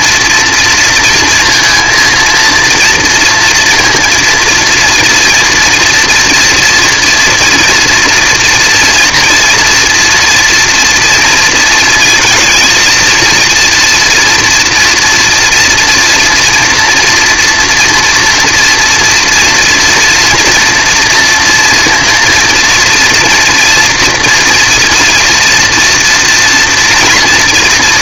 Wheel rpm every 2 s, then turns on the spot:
230, 230, 230, 230, 240, 240, 230, 230, 240, 230, 230, 230, 230, 240.
none